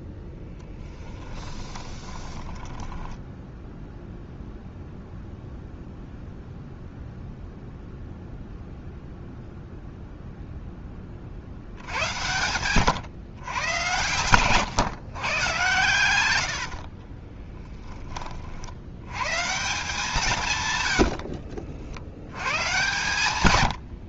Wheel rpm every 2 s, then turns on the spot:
10, 10, 0, 0, 0, 10, 120, 130, 50, 70, 120, 120.
0-4 16-18